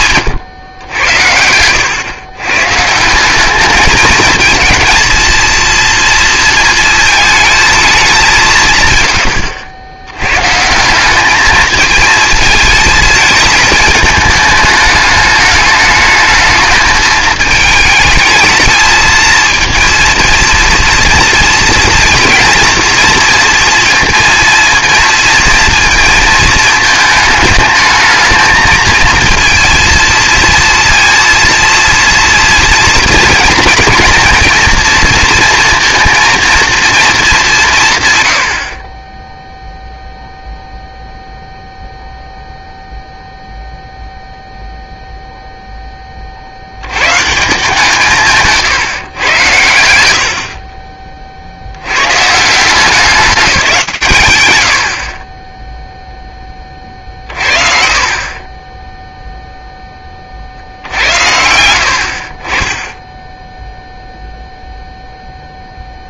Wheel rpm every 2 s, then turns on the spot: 110, 140, 230, 230, 140, 160, 230, 210, 210, 220, 230, 230, 230, 220, 220, 230, 220, 230, 230, 20, 0, 0, 0, 80, 150, 50, 180, 80, 30, 10, 70, 20, 0.
56-60